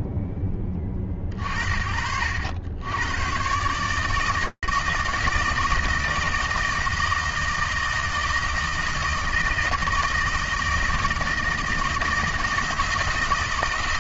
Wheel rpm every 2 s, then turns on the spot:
30, 130, 160, 160, 160, 160, 160.
none